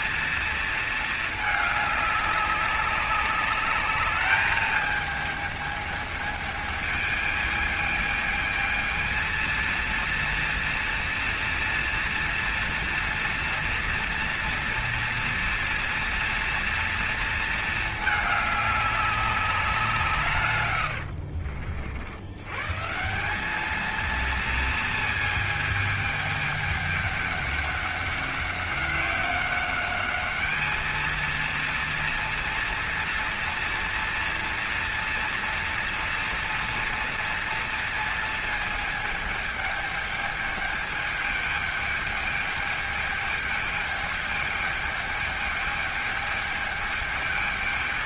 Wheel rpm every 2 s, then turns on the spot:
220, 200, 220, 210, 220, 230, 230, 230, 230, 200, 100, 160, 220, 210, 190, 220, 230, 230, 230, 220, 210, 210, 210, 210.
20-22